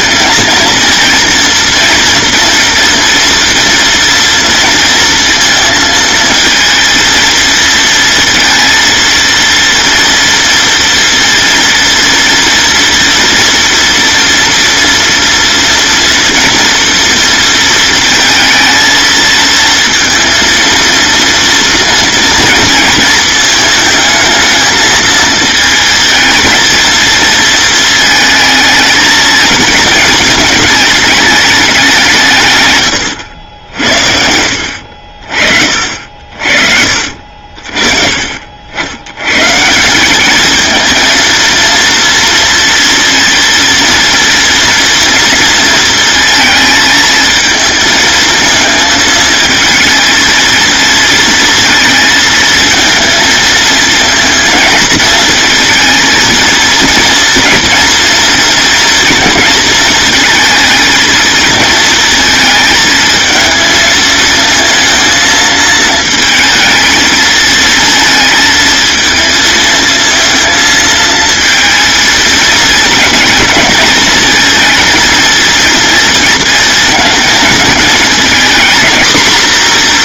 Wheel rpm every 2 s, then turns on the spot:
230, 240, 230, 220, 230, 230, 230, 230, 230, 220, 230, 220, 220, 220, 220, 220, 110, 50, 50, 90, 220, 230, 230, 220, 220, 230, 230, 230, 230, 230, 230, 220, 230, 220, 230, 220, 220, 230, 220, 240.
none